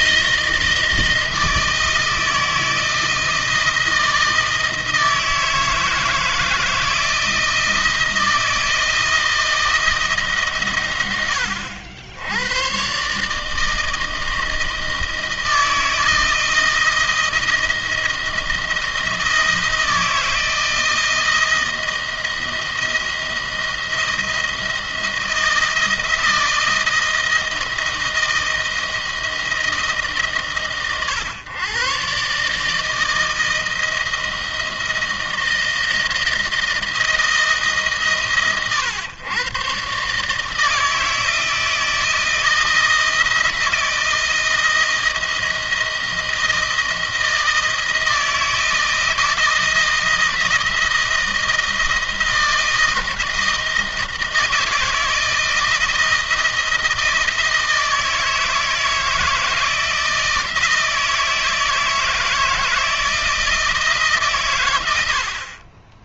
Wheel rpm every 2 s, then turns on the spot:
160, 160, 160, 170, 170, 130, 110, 160, 160, 160, 160, 170, 170, 160, 160, 130, 150, 160, 160, 120, 160, 160, 170, 160, 160, 170, 160, 160, 160, 160, 160, 160, 120.
none